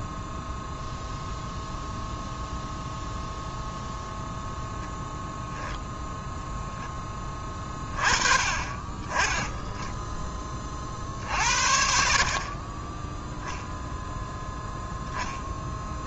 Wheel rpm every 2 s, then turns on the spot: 0, 0, 0, 10, 20, 30, 20, 10.
none